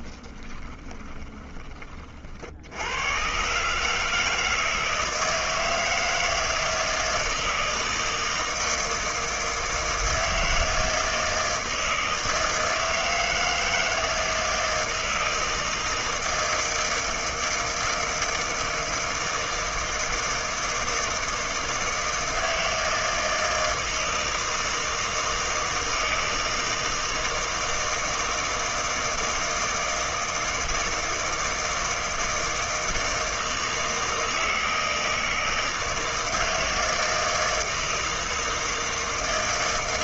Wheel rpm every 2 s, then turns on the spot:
20, 80, 160, 160, 160, 160, 160, 160, 160, 160, 160, 160, 160, 160, 160, 160, 160, 160, 160, 160.
0-2